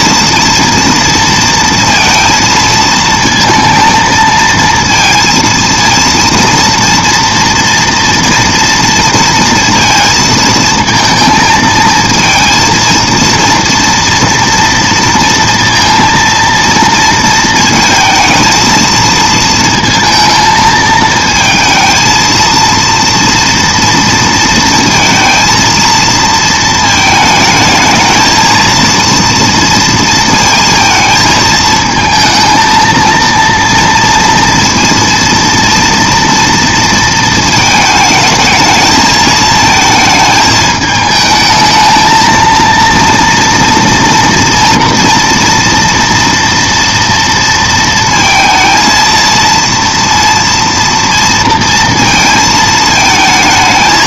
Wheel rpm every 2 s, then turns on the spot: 230, 220, 230, 230, 230, 230, 220, 230, 230, 230, 220, 230, 230, 220, 230, 230, 230, 230, 230, 220, 220, 230, 240, 230, 230, 230, 220.
none